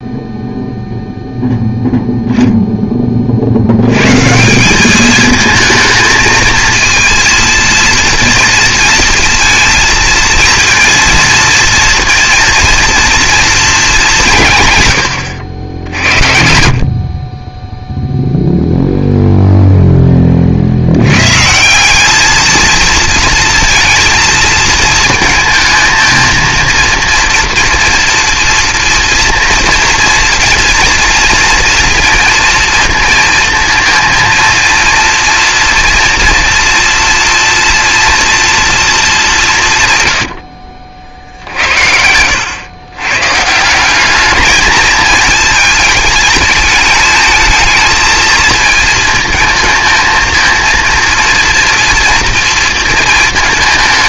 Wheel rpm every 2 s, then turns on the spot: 0, 20, 200, 230, 230, 230, 230, 130, 50, 0, 70, 220, 230, 230, 230, 230, 230, 230, 230, 230, 50, 110, 210, 220, 220, 230, 230.
none